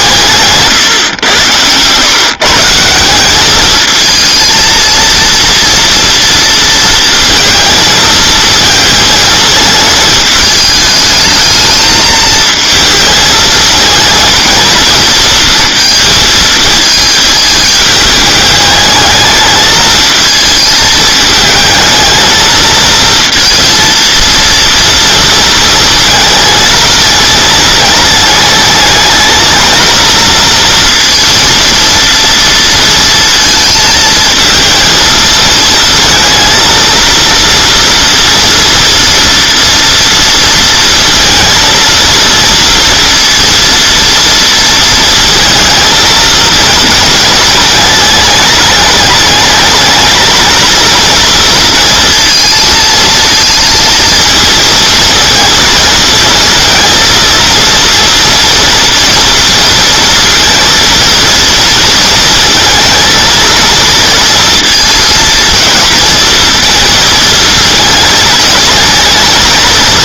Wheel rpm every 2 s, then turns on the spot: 150, 160, 230, 230, 220, 210, 220, 220, 220, 210, 220, 220, 230, 220, 220, 230, 230, 220, 230, 230, 230, 230, 230, 220, 210, 220, 220, 230, 230, 230, 230, 230, 230, 220, 230.
none